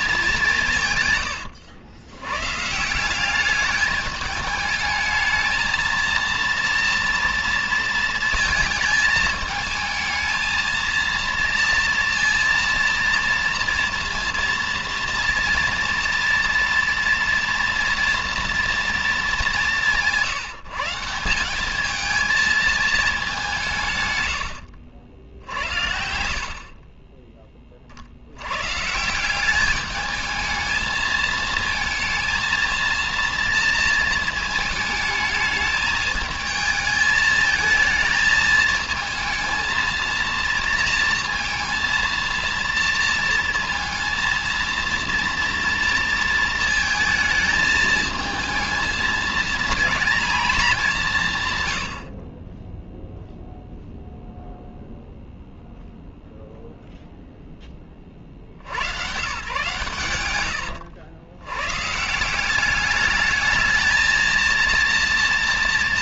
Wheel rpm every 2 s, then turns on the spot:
200, 120, 210, 230, 220, 220, 230, 230, 230, 230, 170, 220, 110, 50, 90, 220, 230, 220, 220, 220, 230, 230, 230, 230, 220, 230, 30, 0, 0, 60, 90, 180, 230.
60-62